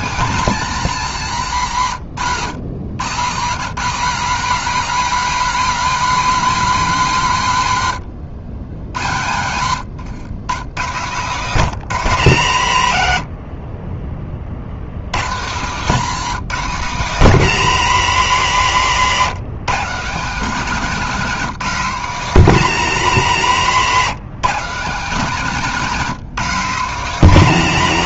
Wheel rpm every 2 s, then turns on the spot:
130, 230, 180, 80, 140, 90, 100, 190, 160, 180, 190, 170, 190, 160.
none